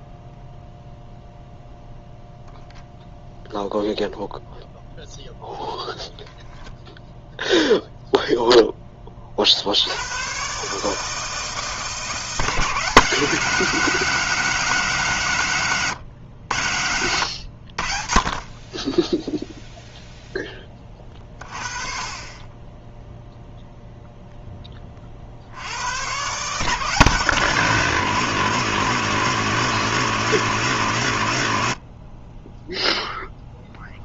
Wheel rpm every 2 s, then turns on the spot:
0, 0, 0, 0, 120, 160, 190, 110, 50, 0, 30, 0, 110, 160, 160, 40, 0.
none